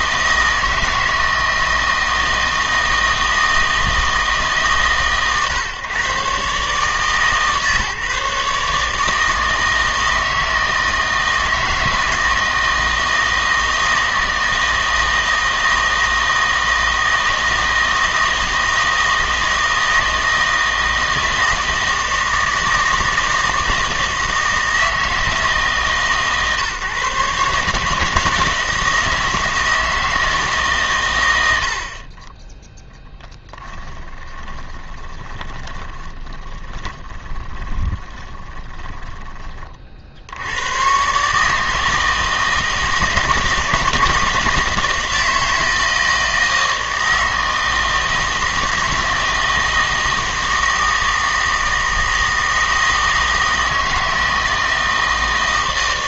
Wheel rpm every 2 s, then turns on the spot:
160, 160, 140, 140, 150, 160, 160, 160, 160, 160, 160, 160, 160, 140, 160, 140, 10, 20, 20, 10, 110, 160, 160, 160, 160, 160, 160, 160.
34-40